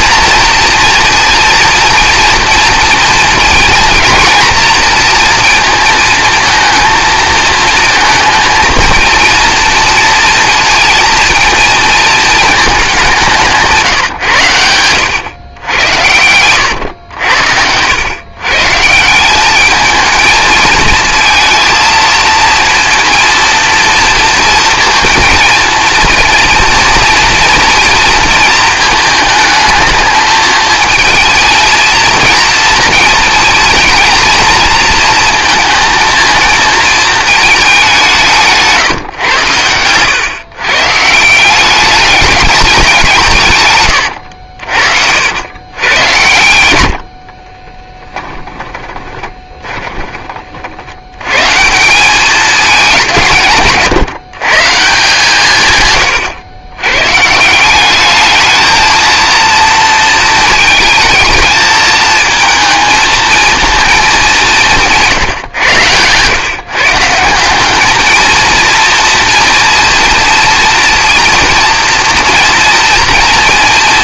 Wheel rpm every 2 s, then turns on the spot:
230, 230, 240, 230, 220, 230, 210, 110, 100, 140, 230, 230, 230, 230, 230, 220, 230, 230, 220, 160, 130, 200, 60, 80, 20, 60, 200, 140, 120, 220, 220, 230, 190, 130, 230, 230, 230.
48-50